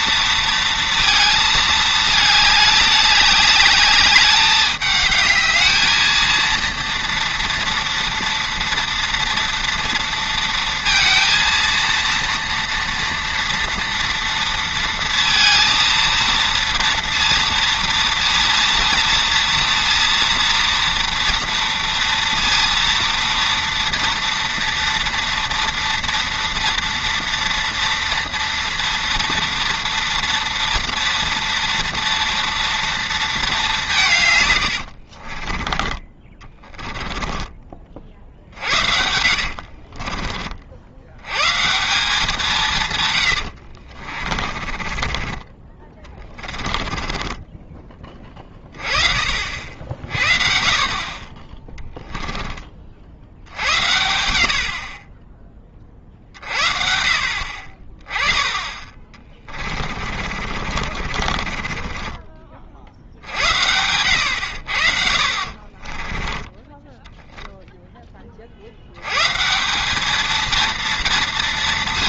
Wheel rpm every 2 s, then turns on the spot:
230, 210, 210, 230, 230, 230, 230, 230, 230, 230, 230, 230, 230, 230, 230, 230, 230, 100, 20, 60, 50, 170, 30, 20, 30, 40, 20, 60, 50, 20, 40, 50, 90, 10, 60, 230.
34-38 44-48 60-62 66-68